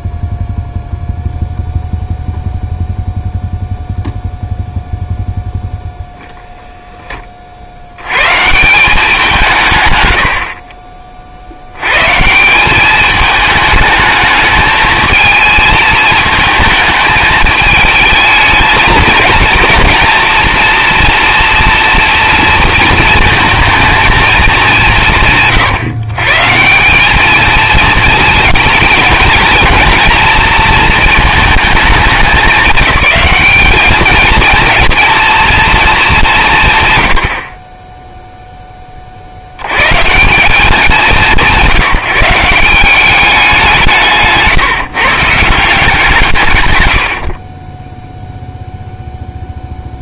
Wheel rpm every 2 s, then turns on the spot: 0, 0, 0, 0, 150, 50, 180, 220, 220, 220, 230, 230, 210, 150, 220, 220, 190, 230, 160, 10, 180, 160, 170, 160, 0.
none